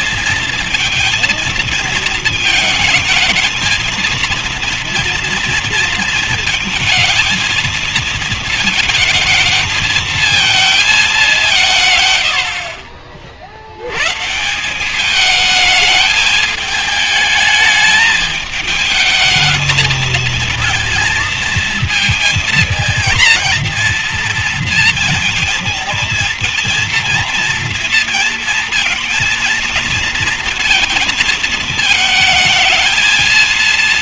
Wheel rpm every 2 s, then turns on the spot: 230, 220, 230, 230, 220, 220, 70, 170, 220, 220, 230, 230, 230, 230, 220, 230, 220.
none